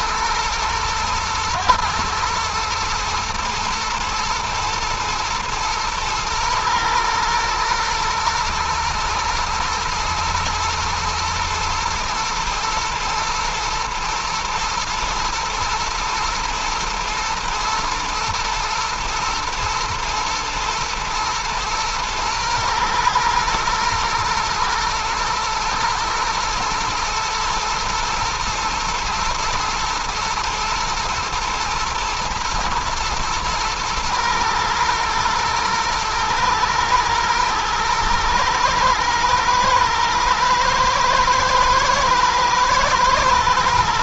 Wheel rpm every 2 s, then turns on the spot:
110, 110, 110, 110, 110, 110, 120, 120, 120, 120, 110, 120, 120, 120, 110, 110, 120, 120, 110, 110, 110, 120.
none